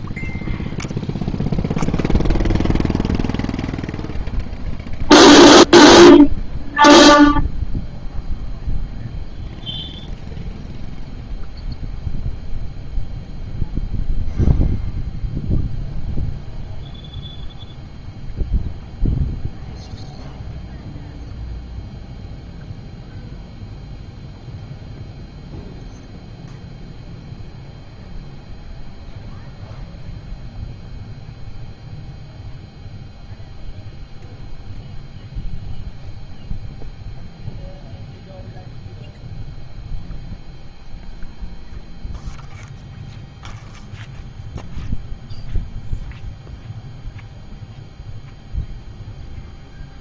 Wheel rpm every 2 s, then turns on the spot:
0, 0, 0, 0, 0, 0, 0, 0, 0, 0, 0, 0, 0, 0, 0, 0, 0, 0, 0, 0, 0, 0, 0, 0, 0.
none